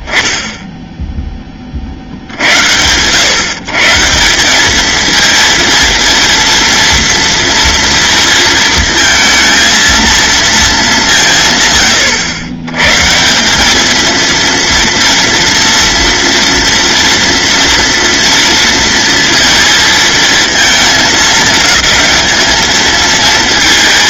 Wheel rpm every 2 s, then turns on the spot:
0, 100, 210, 230, 230, 200, 120, 230, 230, 230, 220, 220.
none